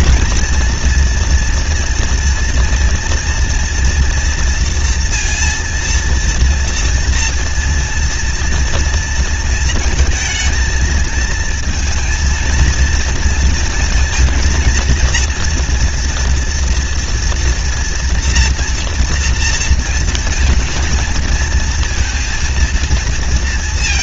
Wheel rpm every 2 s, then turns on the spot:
240, 230, 230, 230, 230, 230, 230, 230, 240, 230, 230, 230.
none